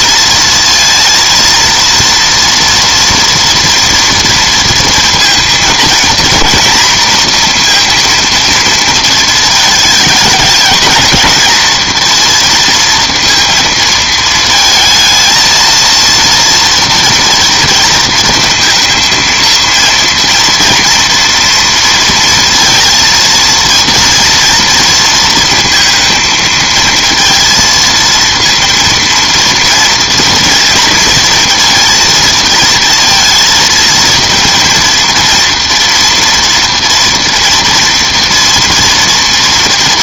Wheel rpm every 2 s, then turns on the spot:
230, 230, 230, 230, 230, 220, 230, 220, 240, 230, 230, 230, 230, 220, 230, 230, 230, 230, 230, 240.
none